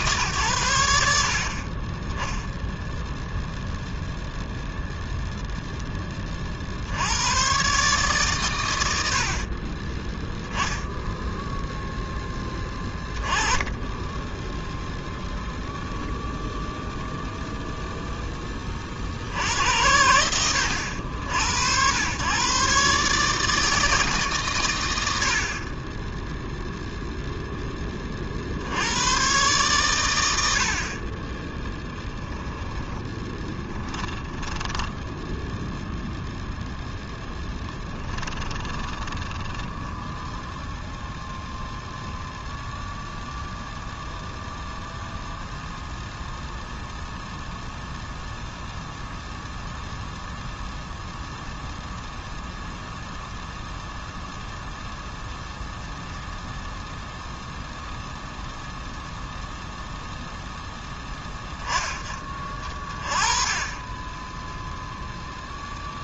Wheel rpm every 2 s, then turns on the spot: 80, 0, 0, 80, 80, 0, 10, 0, 0, 40, 80, 130, 120, 0, 80, 70, 10, 20, 0, 20, 0, 0, 0, 0, 0, 0, 0, 0, 0, 0, 0, 30, 0.
34-36 38-40